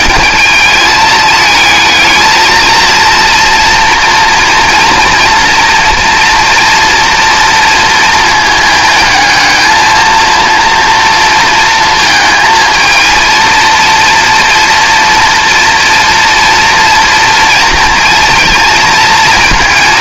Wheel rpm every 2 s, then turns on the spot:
220, 220, 230, 230, 220, 230, 220, 230, 230, 230.
none